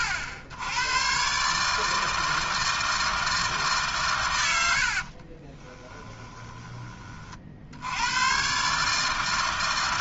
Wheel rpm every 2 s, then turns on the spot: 90, 160, 70, 30, 130.
4-6